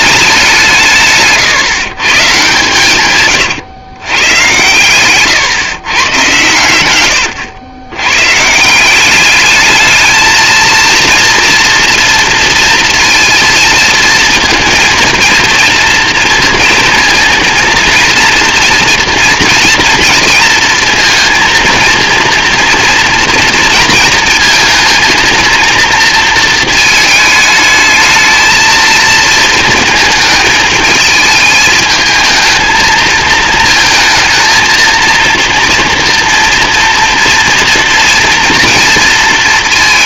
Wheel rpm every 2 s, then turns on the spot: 170, 130, 110, 110, 150, 220, 230, 230, 230, 230, 230, 230, 230, 220, 220, 220, 220, 230, 240, 230.
4-6